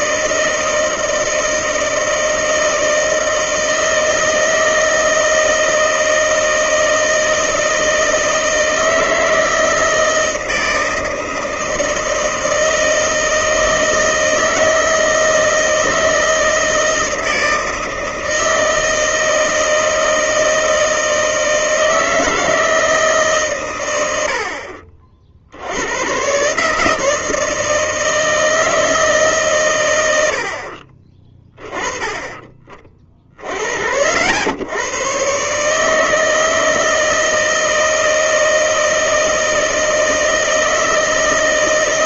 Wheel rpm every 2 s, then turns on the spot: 160, 160, 160, 160, 160, 160, 160, 160, 160, 160, 160, 160, 60, 140, 160, 60, 30, 100, 160, 160, 160.
none